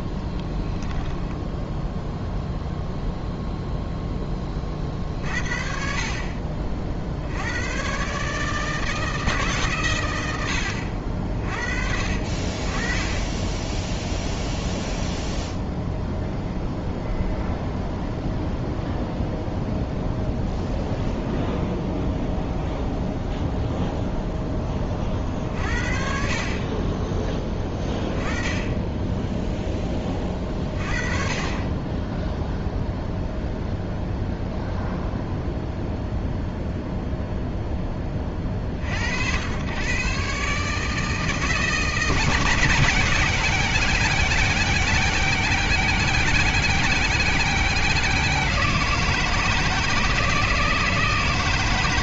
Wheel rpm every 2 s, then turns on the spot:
10, 0, 30, 40, 150, 80, 30, 0, 0, 0, 10, 0, 10, 30, 10, 30, 0, 0, 0, 50, 150, 160, 160, 160, 160, 160.
0-2 20-22